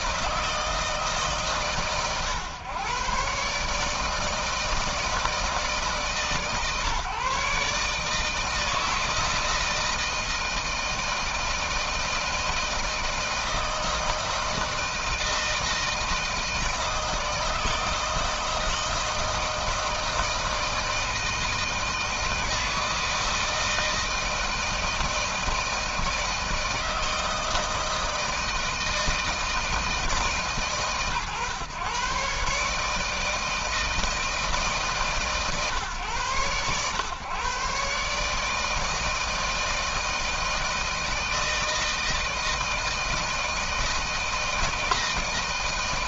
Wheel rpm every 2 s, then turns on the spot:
160, 120, 160, 150, 160, 160, 160, 160, 160, 160, 160, 160, 160, 160, 160, 150, 140, 160, 120, 150, 160, 160, 160.
none